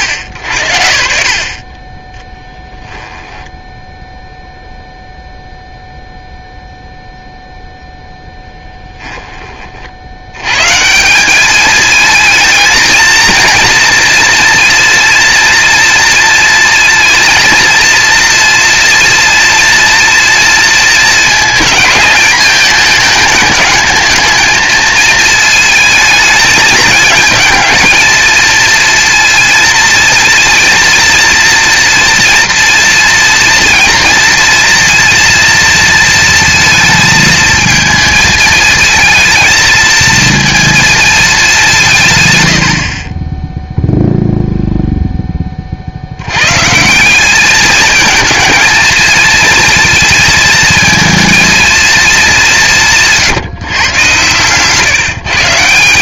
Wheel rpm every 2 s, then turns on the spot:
80, 10, 0, 0, 10, 120, 220, 230, 230, 230, 230, 210, 220, 220, 230, 230, 230, 230, 230, 220, 220, 90, 0, 130, 220, 220, 180, 120.
2-4 8-10